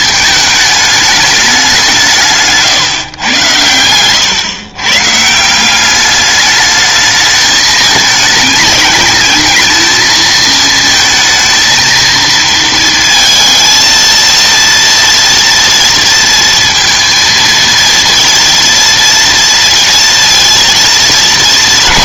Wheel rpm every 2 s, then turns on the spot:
210, 140, 130, 210, 210, 220, 230, 230, 230, 230, 230.
none